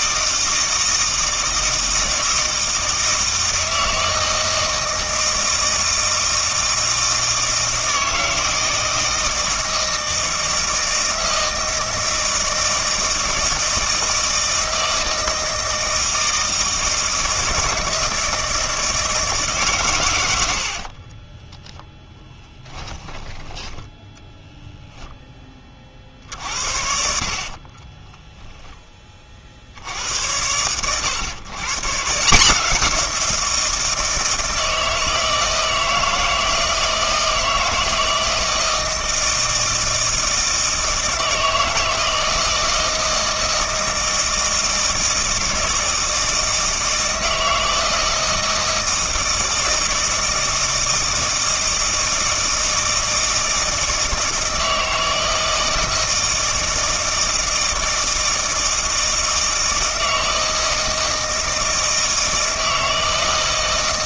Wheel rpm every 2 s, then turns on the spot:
160, 160, 160, 160, 160, 160, 160, 160, 160, 160, 90, 10, 0, 70, 0, 100, 170, 160, 160, 160, 160, 160, 160, 160, 160, 160, 160, 160, 160, 160, 160, 160.
20-24